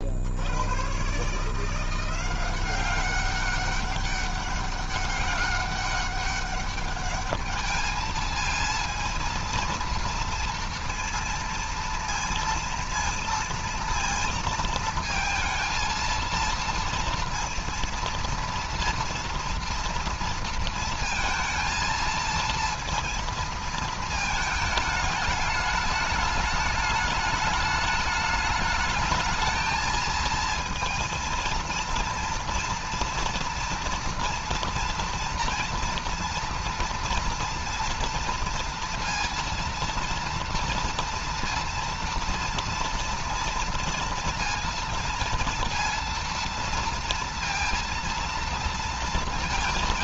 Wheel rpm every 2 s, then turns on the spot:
90, 180, 200, 200, 220, 230, 230, 230, 230, 230, 230, 230, 220, 210, 210, 230, 230, 230, 230, 230, 230, 230, 230, 230, 230.
none